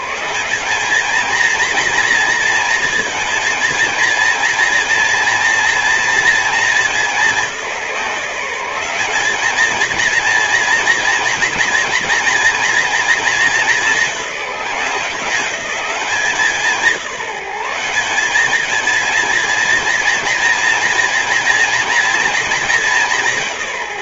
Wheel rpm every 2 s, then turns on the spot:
220, 220, 230, 200, 210, 230, 220, 190, 180, 230, 240, 190.
none